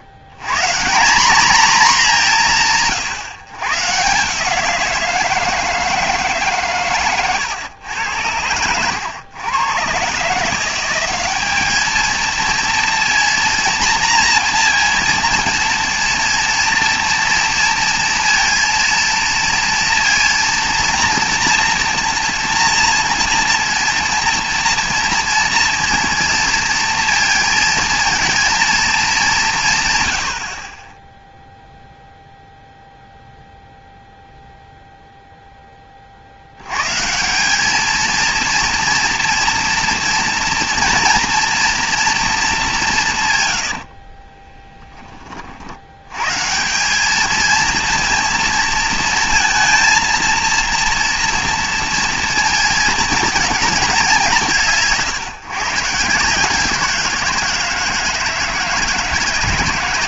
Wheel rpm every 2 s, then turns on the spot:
120, 210, 170, 150, 110, 170, 230, 240, 230, 230, 230, 230, 230, 230, 220, 60, 0, 0, 110, 230, 230, 200, 10, 160, 230, 230, 230, 170, 170, 160.
8-10 44-46